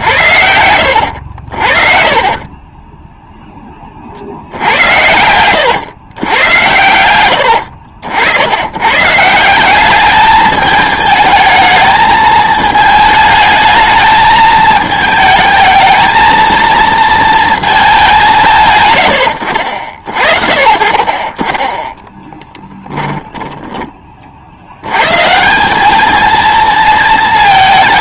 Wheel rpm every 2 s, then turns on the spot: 90, 30, 80, 90, 110, 220, 220, 220, 230, 120, 40, 10, 80, 220.
2-4 22-24